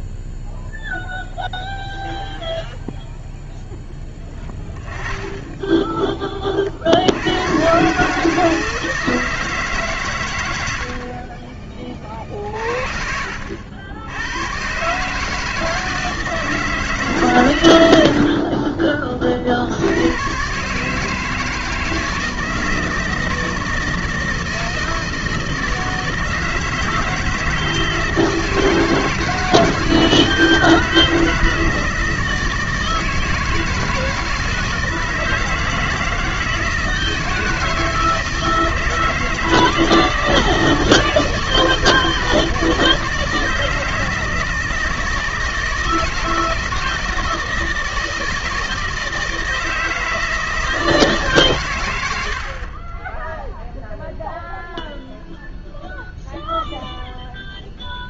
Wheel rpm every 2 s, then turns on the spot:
0, 0, 10, 40, 160, 80, 50, 120, 160, 30, 140, 160, 160, 170, 160, 160, 160, 160, 160, 160, 160, 160, 160, 160, 160, 160, 30, 0, 0.
none